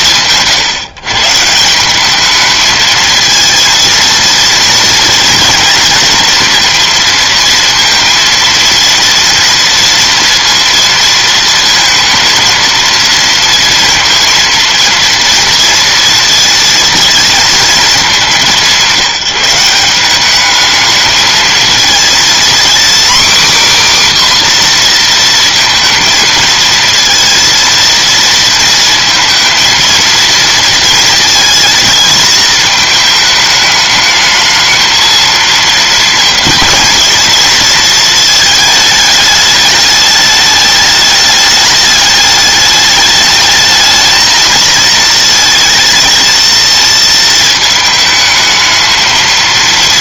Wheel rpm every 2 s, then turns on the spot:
140, 230, 230, 230, 240, 230, 230, 230, 230, 180, 220, 270, 240, 230, 230, 230, 220, 230, 230, 220, 210, 210, 230, 220, 220.
none